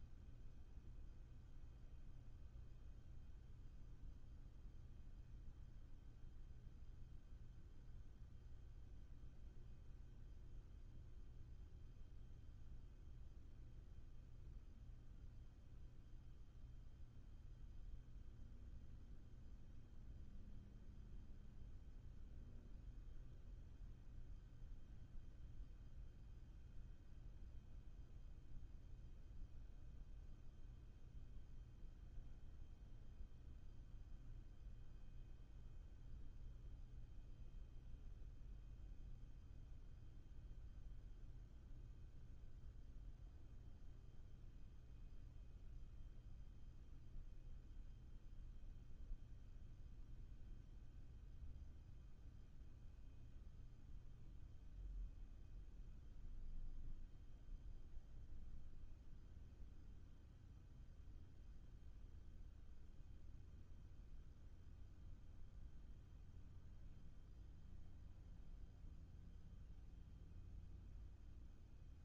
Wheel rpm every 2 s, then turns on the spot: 0, 0, 0, 0, 0, 0, 0, 0, 0, 0, 0, 0, 0, 0, 0, 0, 0, 0, 0, 0, 0, 0, 0, 0, 0, 0, 0, 0, 0, 0, 0, 0, 0, 0, 0, 0.
none